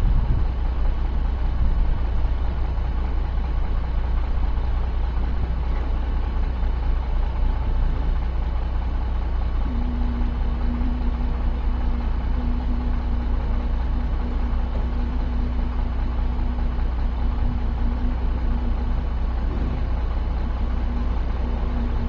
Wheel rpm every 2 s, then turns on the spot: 0, 0, 0, 0, 0, 0, 0, 0, 0, 0, 0.
none